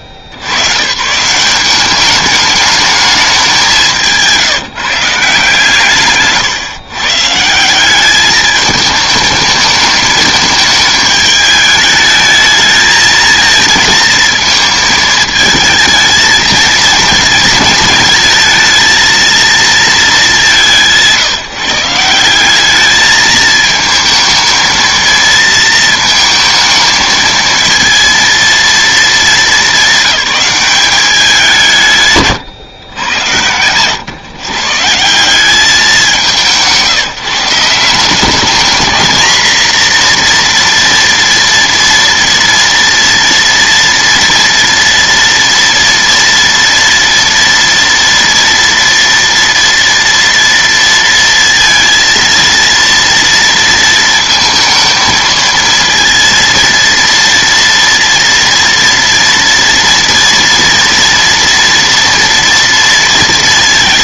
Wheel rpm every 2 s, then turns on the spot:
90, 210, 170, 140, 210, 220, 220, 220, 220, 220, 190, 190, 230, 220, 230, 200, 120, 140, 150, 210, 240, 230, 230, 230, 230, 230, 230, 220, 230, 230, 230, 230.
none